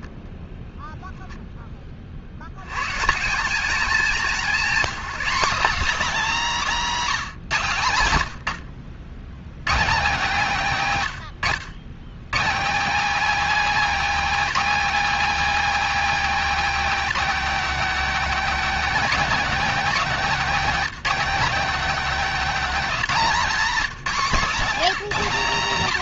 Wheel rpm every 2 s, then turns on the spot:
0, 40, 210, 220, 60, 180, 180, 280, 270, 260, 220, 250, 220.
none